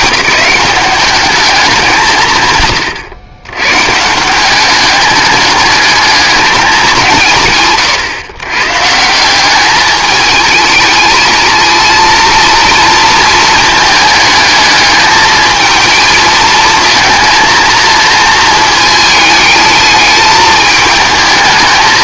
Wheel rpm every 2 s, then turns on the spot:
190, 130, 190, 210, 130, 220, 230, 210, 230, 220, 210.
none